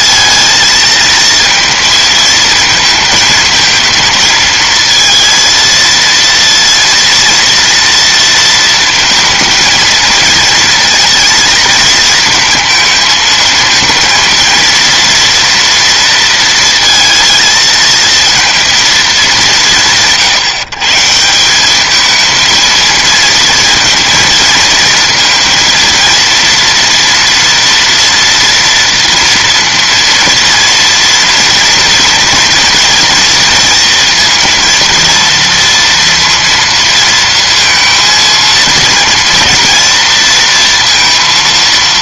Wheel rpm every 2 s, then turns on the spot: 230, 220, 220, 230, 230, 230, 220, 230, 230, 230, 150, 220, 230, 230, 230, 230, 230, 230, 230, 230, 230.
none